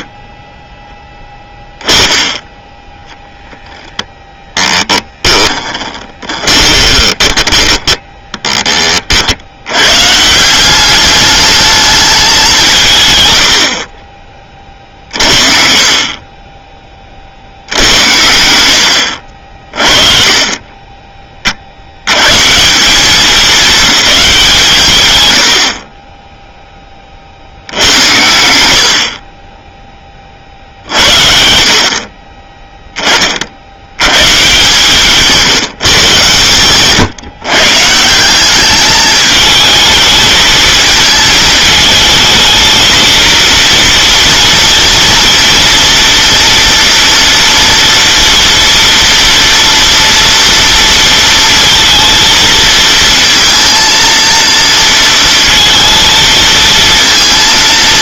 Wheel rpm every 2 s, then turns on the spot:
10, 0, 10, 10, 60, 210, 110, 50, 40, 70, 20, 200, 130, 30, 70, 60, 10, 150, 130, 200, 220, 220, 230, 240, 230, 230, 220, 230, 230.
4-8